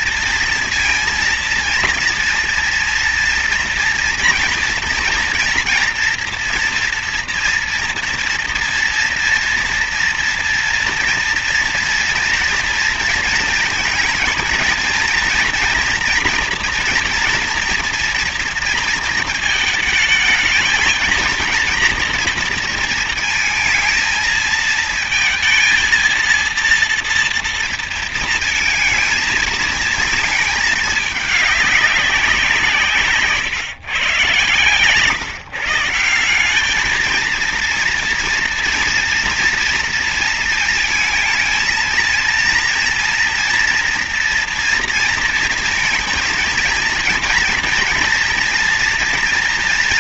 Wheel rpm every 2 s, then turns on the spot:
230, 230, 230, 230, 230, 230, 230, 230, 240, 230, 220, 220, 230, 230, 230, 210, 180, 150, 200, 230, 230, 230, 230, 230, 240.
34-36